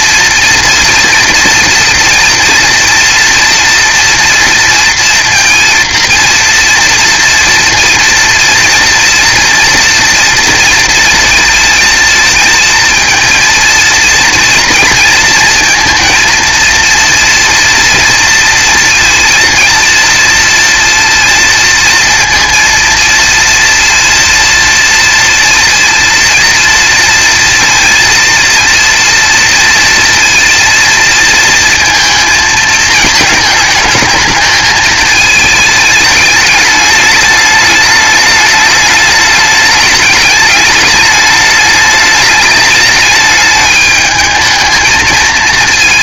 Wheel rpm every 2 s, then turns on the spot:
230, 230, 230, 230, 230, 230, 230, 230, 230, 230, 230, 230, 230, 230, 240, 230, 220, 220, 210, 210, 210, 210, 220.
none